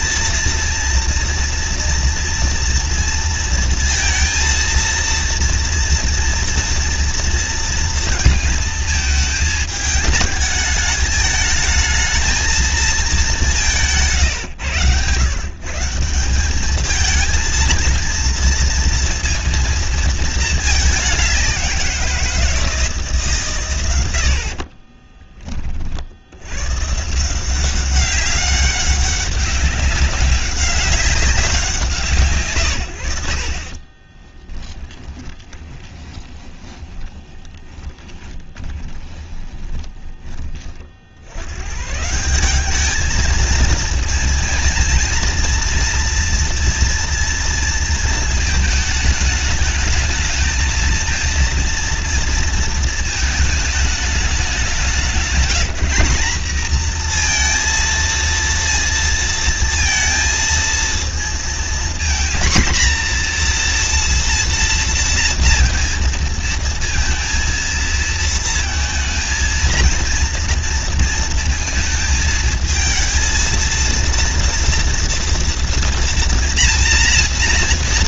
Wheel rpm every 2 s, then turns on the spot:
230, 230, 230, 230, 220, 210, 220, 110, 210, 230, 220, 170, 50, 120, 200, 200, 130, 10, 20, 20, 50, 200, 230, 230, 220, 220, 230, 190, 230, 230, 230, 240, 230, 230, 220, 230, 220, 230, 240.
24-26 34-40